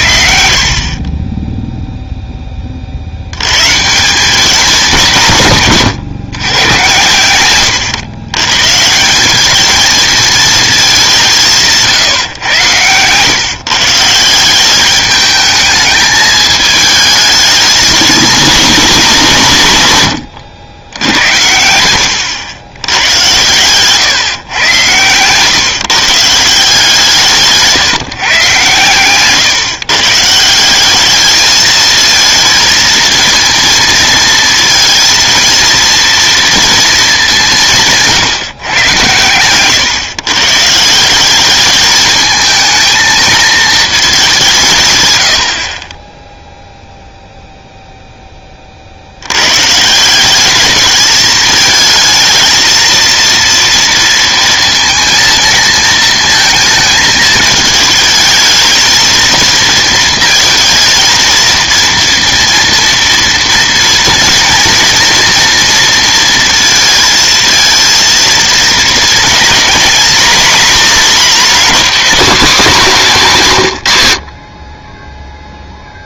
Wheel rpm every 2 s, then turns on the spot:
50, 30, 200, 130, 130, 210, 120, 180, 220, 220, 100, 100, 130, 170, 130, 170, 220, 230, 230, 140, 140, 220, 160, 0, 30, 200, 230, 230, 220, 220, 230, 230, 230, 230, 230, 260, 240, 50.
0-2 74-76